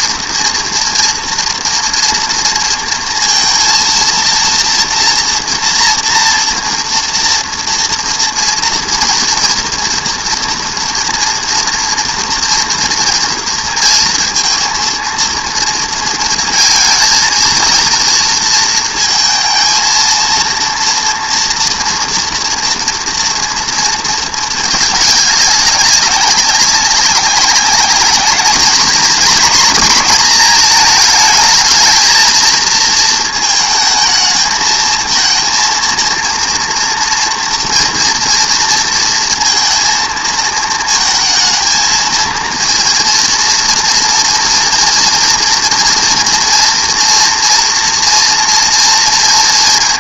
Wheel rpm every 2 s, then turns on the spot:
230, 230, 230, 230, 230, 230, 230, 230, 230, 230, 230, 230, 210, 190, 220, 220, 230, 220, 230, 230, 220, 230, 230, 230, 230.
none